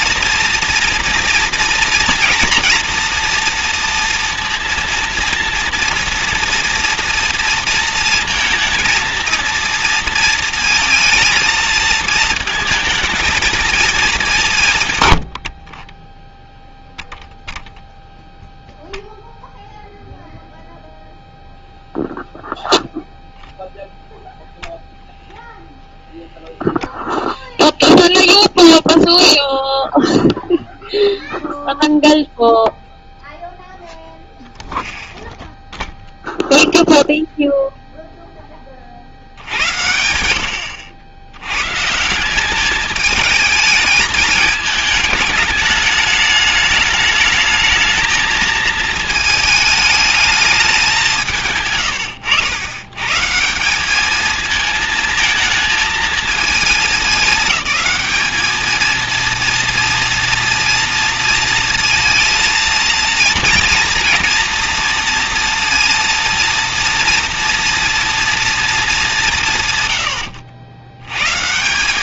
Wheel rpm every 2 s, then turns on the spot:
230, 230, 230, 230, 230, 220, 220, 50, 0, 0, 0, 0, 0, 0, 0, 0, 0, 0, 0, 50, 80, 210, 220, 210, 220, 190, 100, 220, 220, 210, 230, 230, 230, 230, 220, 70.
none